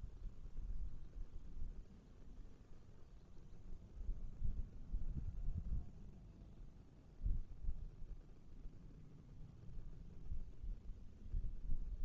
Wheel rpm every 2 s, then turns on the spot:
0, 0, 0, 0, 0, 0.
none